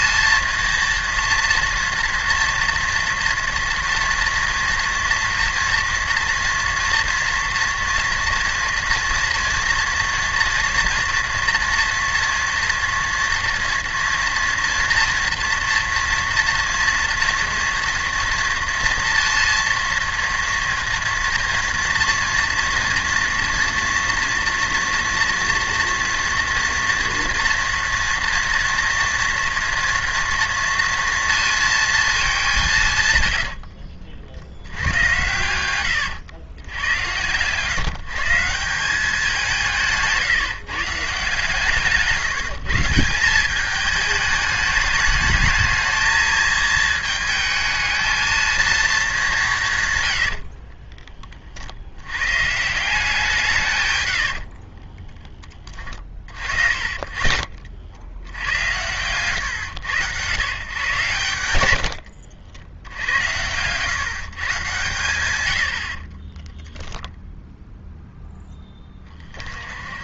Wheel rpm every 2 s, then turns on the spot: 240, 230, 230, 240, 230, 230, 230, 230, 230, 230, 230, 230, 230, 230, 230, 230, 150, 100, 100, 180, 140, 170, 210, 220, 210, 30, 170, 30, 40, 100, 110, 90, 120, 0, 20.
50-52 54-56